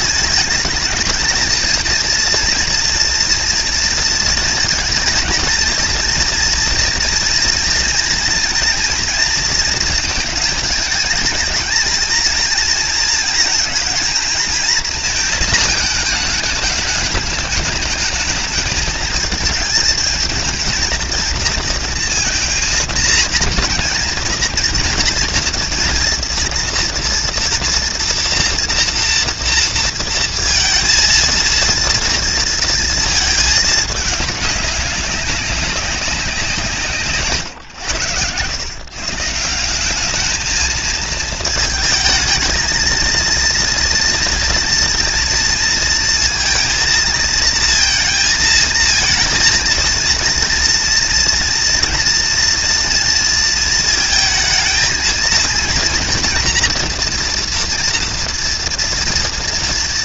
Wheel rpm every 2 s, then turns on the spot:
220, 230, 230, 230, 230, 230, 230, 230, 210, 210, 220, 230, 230, 230, 230, 230, 230, 200, 170, 120, 220, 220, 230, 220, 220, 230, 230, 220, 230, 230.
none